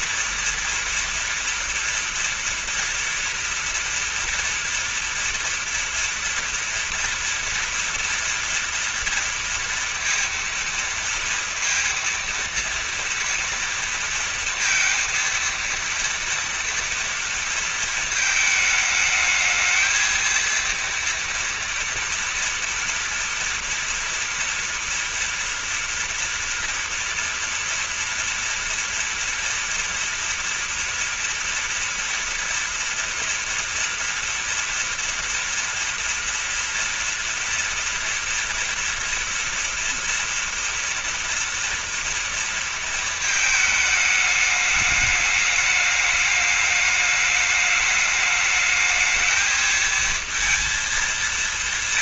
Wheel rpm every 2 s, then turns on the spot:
230, 230, 230, 230, 230, 230, 230, 230, 230, 220, 230, 230, 240, 230, 230, 230, 230, 230, 240, 230, 230, 230, 210, 210, 210, 230.
none